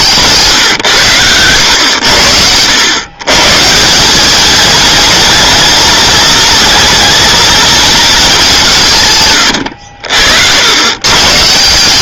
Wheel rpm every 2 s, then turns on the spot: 130, 90, 220, 220, 190, 90.
none